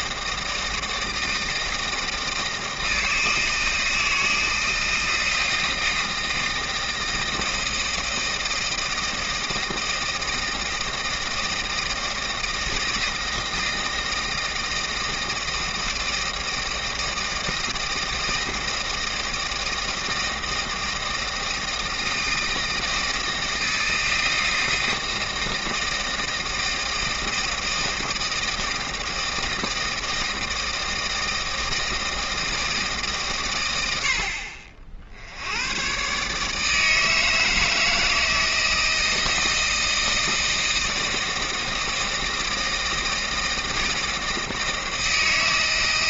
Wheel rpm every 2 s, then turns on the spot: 160, 160, 160, 160, 160, 160, 160, 160, 160, 160, 160, 160, 160, 160, 160, 160, 160, 60, 150, 160, 160, 160, 160.
none